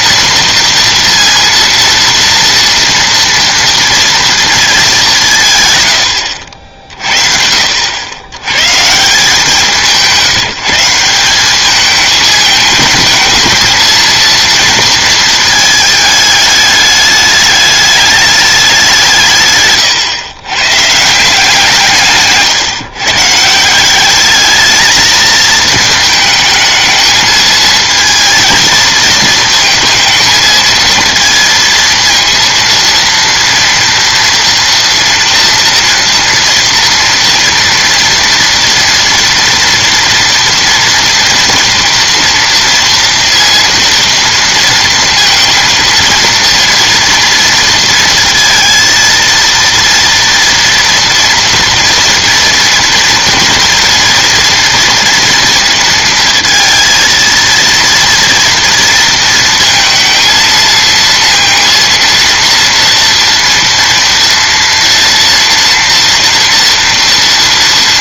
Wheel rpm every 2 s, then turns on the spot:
230, 230, 220, 70, 120, 170, 220, 230, 210, 200, 120, 150, 220, 220, 230, 220, 230, 230, 230, 230, 230, 230, 230, 230, 230, 230, 230, 230, 230, 230, 220, 230, 230, 230.
none